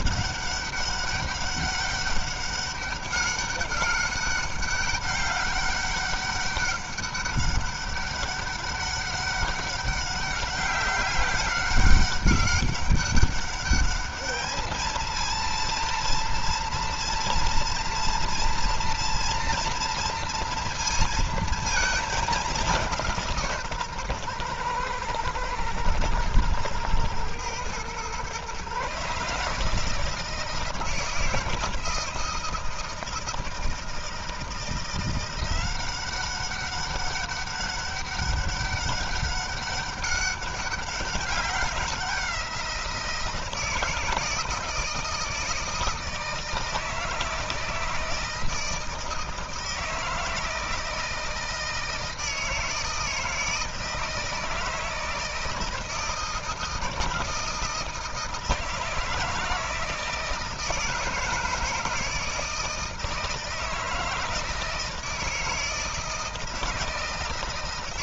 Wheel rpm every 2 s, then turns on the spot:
200, 200, 200, 200, 200, 200, 200, 220, 230, 230, 230, 180, 120, 110, 130, 160, 160, 170, 190, 200, 190, 170, 160, 160, 160, 170, 160, 160, 160, 160, 160, 160, 160, 160.
none